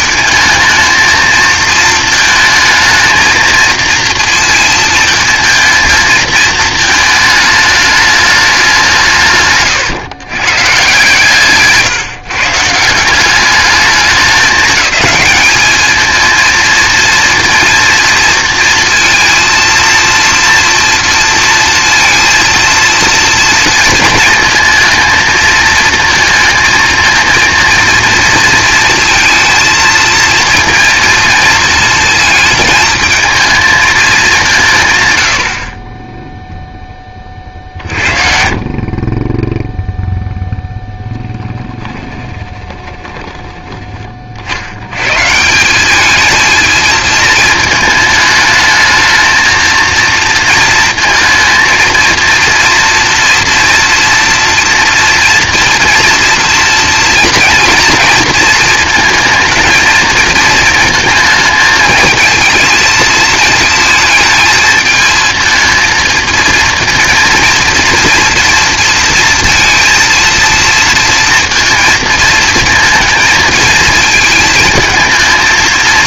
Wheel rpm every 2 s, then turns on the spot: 220, 230, 230, 220, 190, 140, 140, 210, 230, 230, 230, 230, 230, 230, 230, 230, 220, 170, 0, 40, 0, 10, 70, 220, 220, 230, 230, 230, 230, 230, 220, 220, 220, 230, 230, 230, 220, 220.
42-44